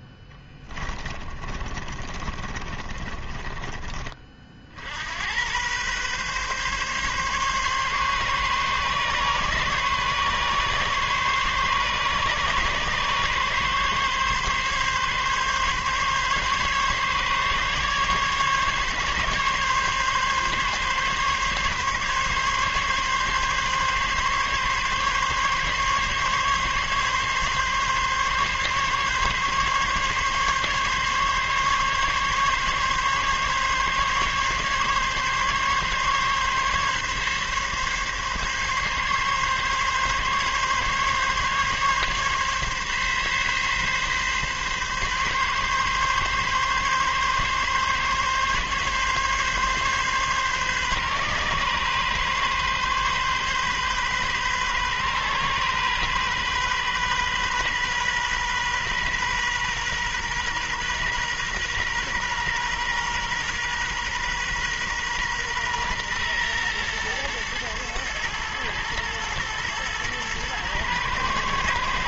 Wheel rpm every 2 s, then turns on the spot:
20, 30, 50, 140, 140, 140, 140, 140, 140, 140, 140, 140, 140, 140, 140, 140, 140, 140, 140, 140, 140, 140, 140, 140, 140, 130, 130, 130, 130, 130, 120, 120, 130, 120, 110, 110.
0-4